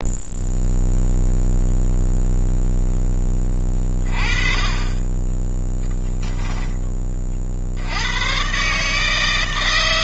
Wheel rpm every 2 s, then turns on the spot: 0, 10, 20, 30, 150.
none